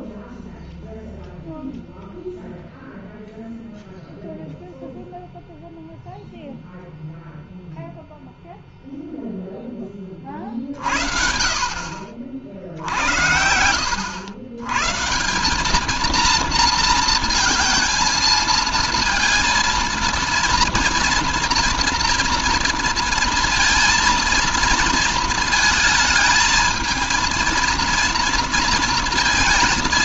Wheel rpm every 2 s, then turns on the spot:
0, 0, 0, 0, 0, 50, 60, 90, 230, 230, 230, 230, 230, 230, 230.
none